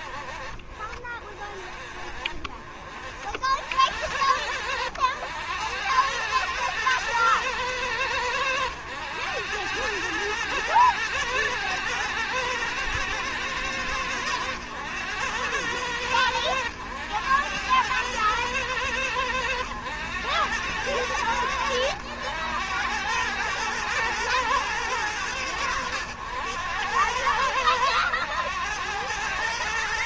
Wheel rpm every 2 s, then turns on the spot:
50, 60, 90, 110, 90, 110, 120, 100, 100, 110, 100, 100, 110, 100, 100.
none